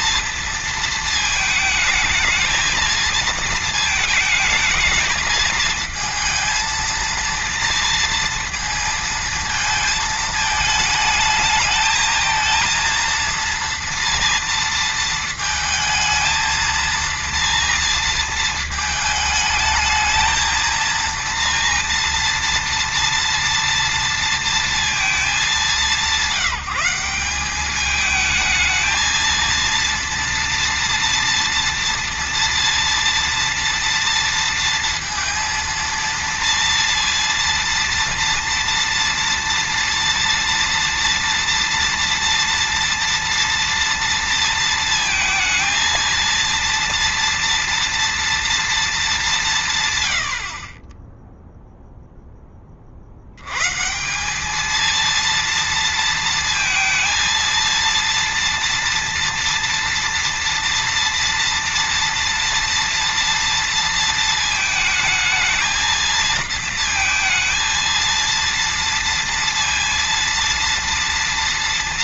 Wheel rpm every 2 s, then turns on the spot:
230, 220, 220, 230, 230, 220, 230, 230, 230, 220, 230, 230, 230, 190, 220, 230, 240, 230, 230, 230, 230, 230, 230, 230, 220, 30, 40, 220, 230, 230, 230, 230, 220, 230, 230, 230.
none